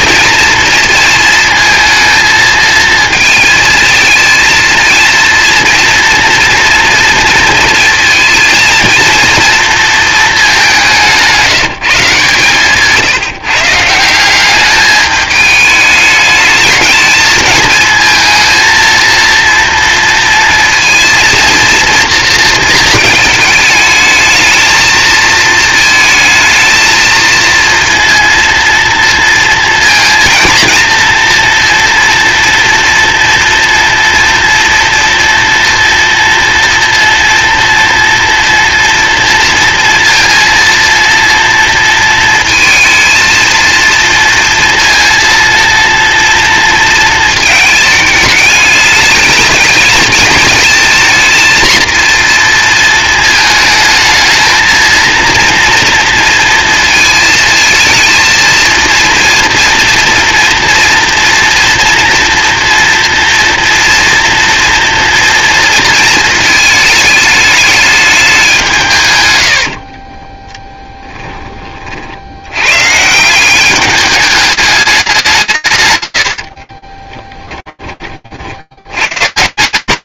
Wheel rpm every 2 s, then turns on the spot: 220, 220, 230, 230, 230, 190, 150, 210, 220, 230, 230, 230, 220, 220, 230, 230, 230, 230, 240, 230, 230, 230, 230, 230, 210, 230, 230, 220, 230, 230, 230, 230, 230, 220, 160, 10, 120, 210, 40, 80.
76-78